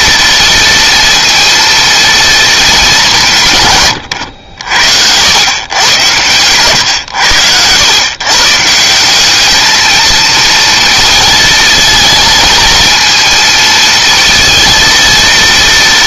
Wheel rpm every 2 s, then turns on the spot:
230, 210, 80, 120, 150, 230, 230, 230.
none